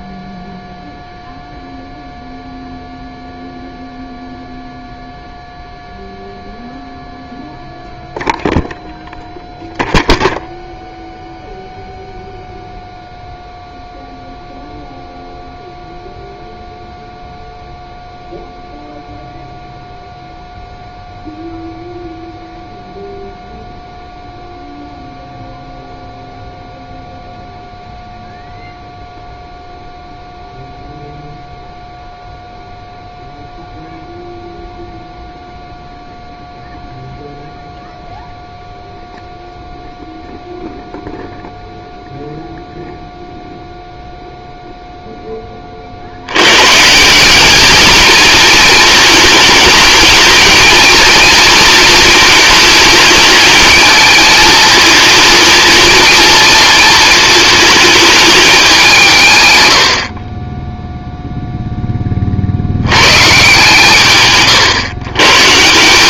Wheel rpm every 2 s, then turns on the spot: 0, 0, 0, 0, 0, 0, 0, 0, 0, 0, 0, 0, 0, 0, 0, 0, 0, 0, 0, 0, 0, 0, 0, 130, 220, 220, 210, 220, 230, 200, 10, 50, 80.
none